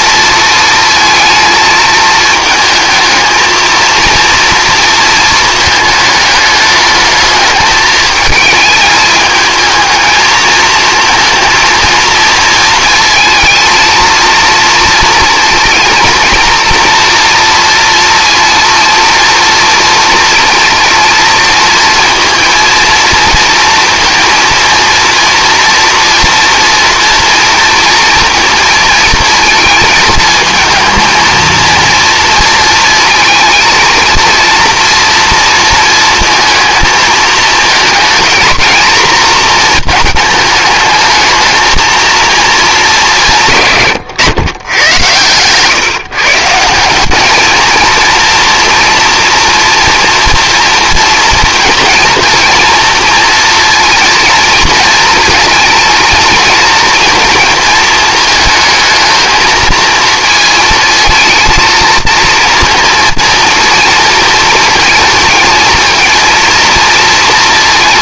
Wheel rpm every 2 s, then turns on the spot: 230, 220, 230, 210, 220, 230, 230, 230, 230, 230, 230, 230, 230, 240, 230, 230, 230, 230, 220, 240, 210, 210, 120, 170, 240, 230, 230, 230, 230, 220, 220, 230, 230, 230.
none